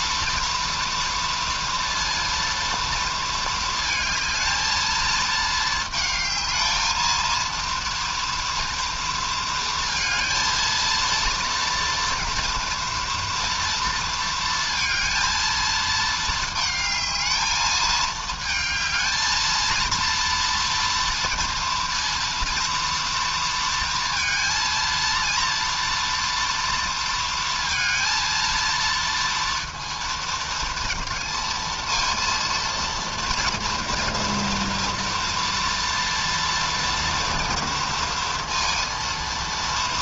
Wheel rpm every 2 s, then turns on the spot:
230, 230, 220, 220, 230, 230, 240, 230, 220, 220, 230, 230, 230, 230, 230, 230, 230, 230, 230, 230.
none